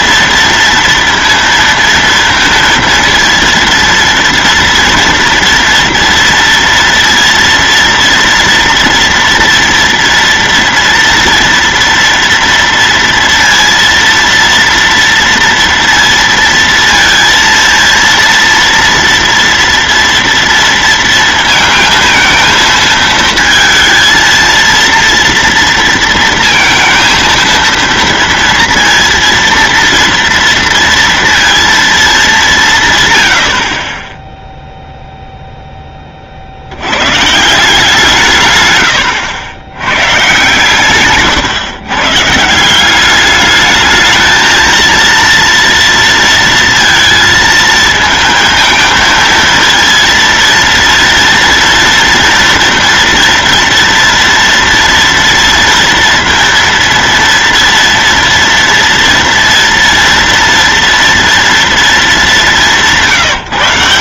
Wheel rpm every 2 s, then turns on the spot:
230, 230, 230, 230, 230, 230, 230, 230, 230, 230, 230, 230, 230, 230, 230, 230, 110, 0, 80, 120, 140, 180, 230, 230, 230, 230, 240, 230, 230, 230, 230, 180.
none